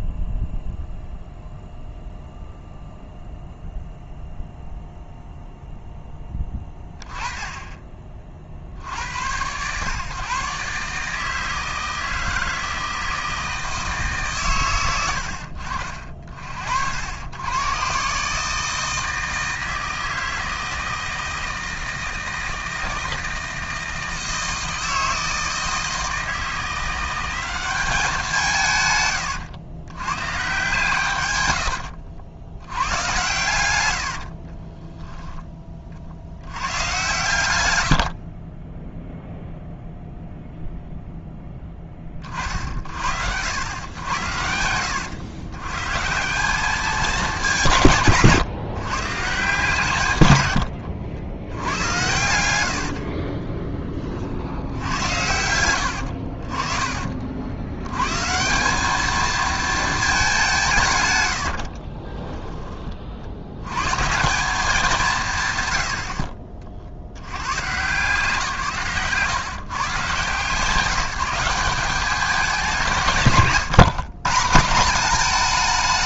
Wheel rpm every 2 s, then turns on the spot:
0, 0, 0, 20, 60, 140, 160, 120, 50, 150, 160, 160, 160, 170, 150, 150, 90, 40, 100, 20, 0, 40, 90, 190, 140, 100, 70, 70, 50, 180, 180, 20, 190, 50, 130, 160, 190, 190.
34-36 38-40 50-52